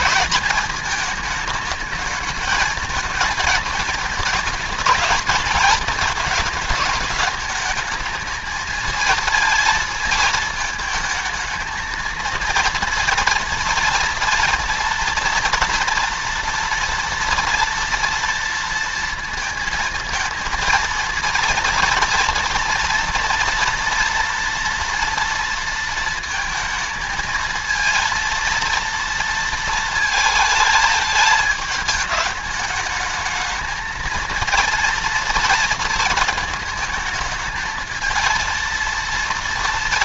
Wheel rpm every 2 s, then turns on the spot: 210, 220, 220, 220, 220, 220, 230, 230, 240, 230, 230, 230, 230, 220, 230, 220, 220, 230, 220, 230.
none